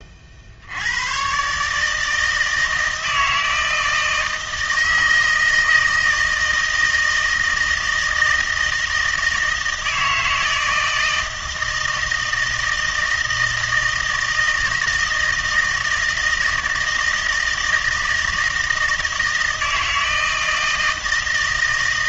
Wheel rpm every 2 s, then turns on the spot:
70, 160, 160, 160, 160, 160, 160, 160, 160, 160, 160.
none